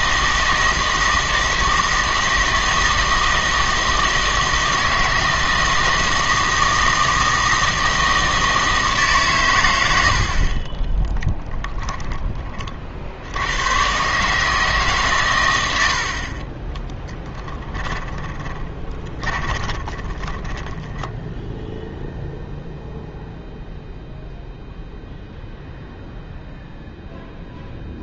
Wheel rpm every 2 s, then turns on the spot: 160, 160, 160, 160, 160, 30, 40, 150, 10, 20, 10, 0, 0, 0.
16-22